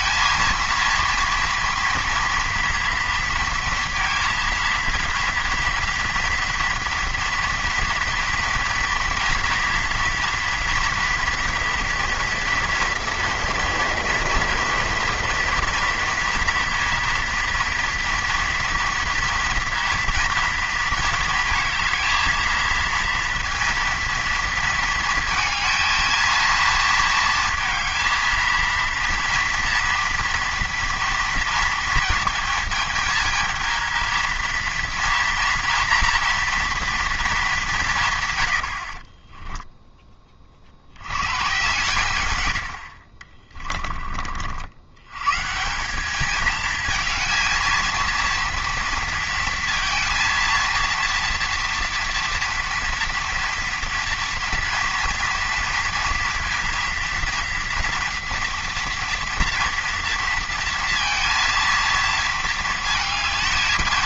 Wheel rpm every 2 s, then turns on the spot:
230, 230, 230, 240, 230, 230, 230, 230, 230, 230, 230, 230, 230, 230, 230, 240, 220, 230, 230, 70, 50, 80, 70, 220, 230, 230, 230, 230, 230, 230, 230, 220.
none